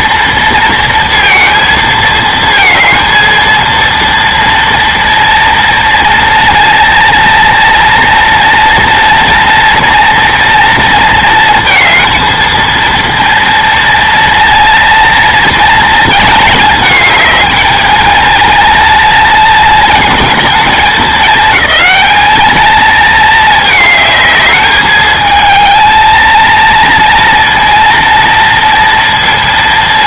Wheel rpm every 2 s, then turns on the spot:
230, 220, 230, 230, 230, 230, 230, 230, 220, 230, 210, 220, 220, 230, 230.
none